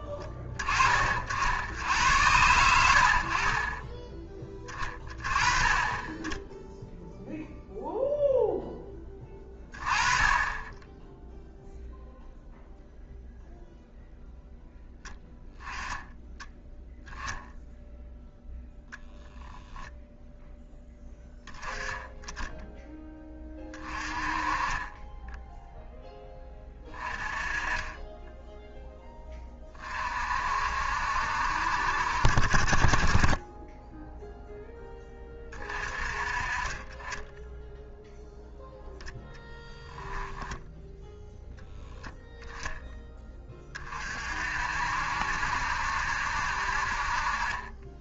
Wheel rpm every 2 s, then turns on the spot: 30, 80, 20, 0, 10, 10, 0, 0, 0, 10, 10, 10, 20, 20, 10, 60, 40, 10, 30, 0, 0, 10, 60, 50.
none